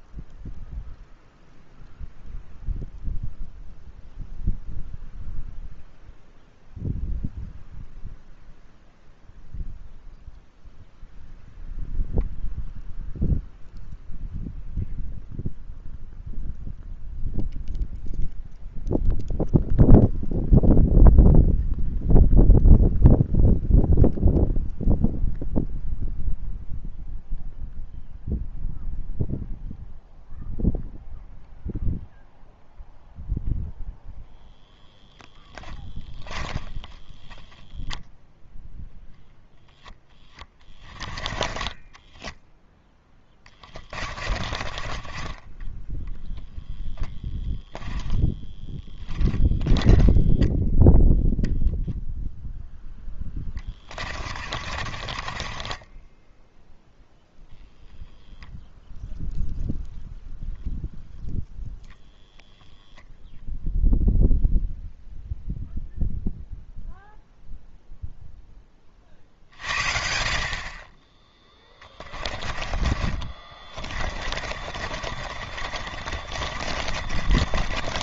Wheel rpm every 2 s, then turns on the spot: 0, 0, 0, 0, 0, 0, 0, 0, 0, 0, 0, 0, 0, 0, 0, 0, 0, 10, 20, 0, 10, 0, 30, 10, 10, 0, 0, 40, 0, 0, 0, 0, 0, 0, 20, 40, 30, 40, 40.
36-38 40-42 44-50 54-56 74-78